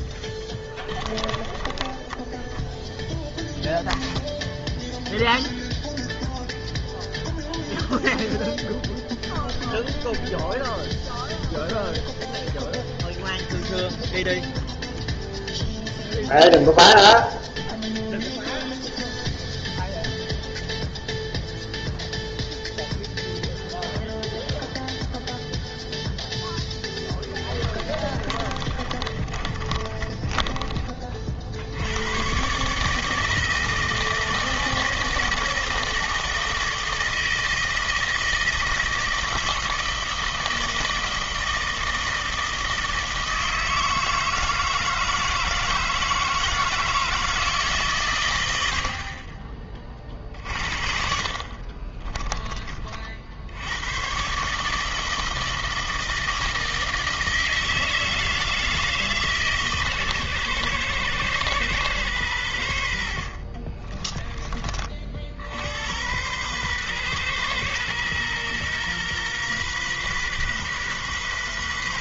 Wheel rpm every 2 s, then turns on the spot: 10, 0, 0, 0, 0, 0, 0, 0, 0, 0, 0, 0, 0, 10, 30, 20, 130, 160, 160, 160, 160, 160, 160, 160, 90, 50, 30, 140, 160, 160, 120, 100, 30, 120, 120, 130.
0-2 28-32